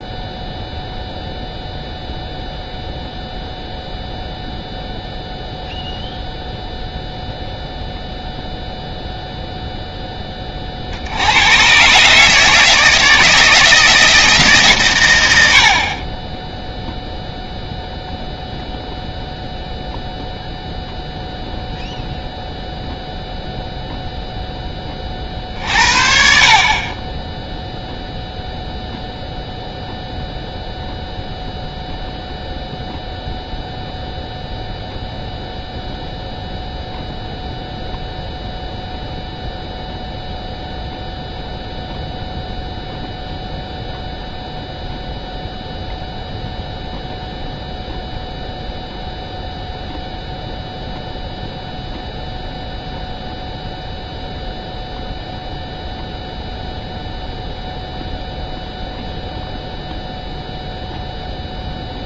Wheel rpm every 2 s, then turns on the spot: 0, 0, 0, 0, 0, 30, 150, 150, 20, 0, 0, 0, 10, 40, 0, 0, 0, 0, 0, 0, 0, 0, 0, 0, 0, 0, 0, 0, 0, 0, 0.
none